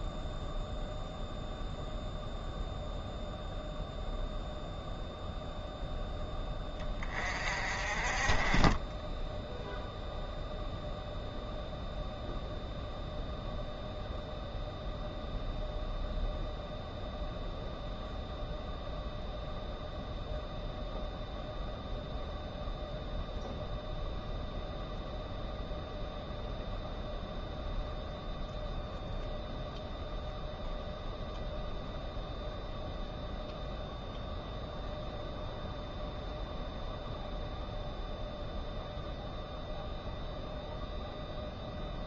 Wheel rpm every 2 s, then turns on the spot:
0, 0, 0, 20, 20, 0, 0, 0, 0, 0, 0, 0, 0, 0, 0, 0, 0, 0, 0, 0, 0.
8-10